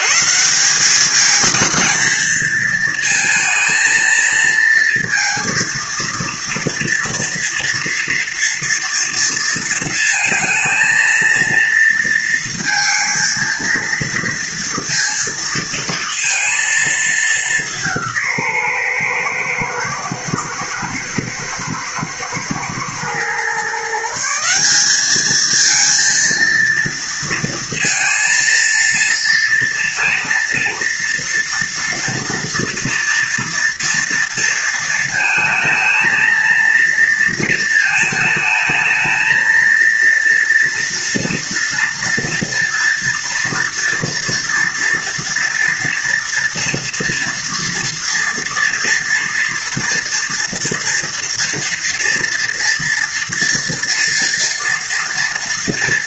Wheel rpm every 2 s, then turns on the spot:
70, 220, 230, 230, 230, 230, 230, 230, 230, 180, 110, 110, 150, 230, 230, 230, 240, 230, 230, 220, 230, 230, 230, 230, 230, 230, 230, 230.
none